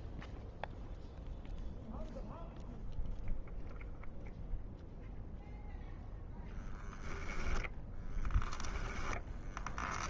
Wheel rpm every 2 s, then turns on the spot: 0, 0, 0, 10, 10.
8-10